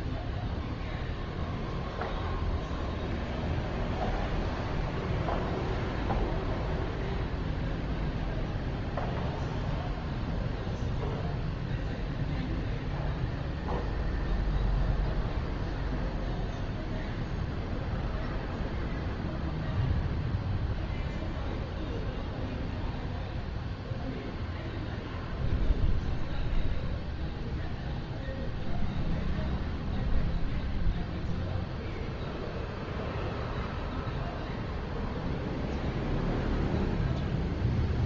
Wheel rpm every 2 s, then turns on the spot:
0, 0, 0, 0, 0, 0, 0, 0, 0, 0, 0, 0, 0, 0, 0, 0, 0, 0, 0.
none